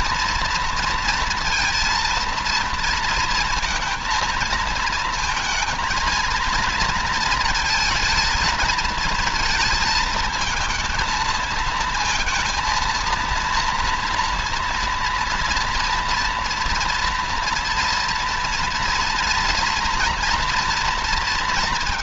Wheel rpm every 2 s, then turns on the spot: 230, 230, 230, 230, 230, 220, 230, 230, 230, 240, 230.
none